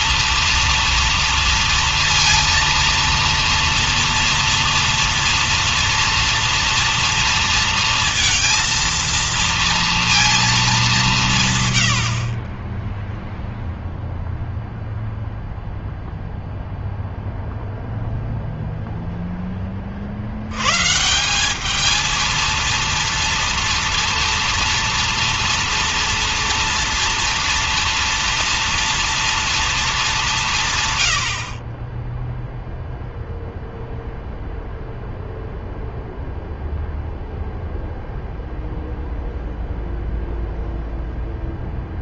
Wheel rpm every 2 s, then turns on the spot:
230, 230, 230, 230, 230, 190, 10, 0, 0, 0, 160, 230, 230, 230, 230, 120, 0, 0, 0, 0, 0.
none